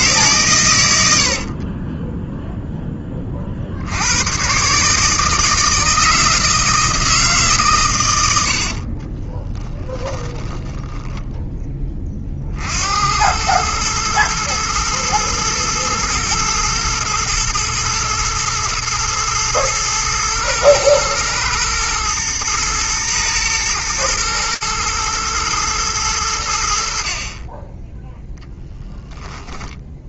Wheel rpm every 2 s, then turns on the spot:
120, 10, 140, 160, 70, 10, 60, 110, 120, 120, 110, 120, 110, 70, 10.
8-12 28-30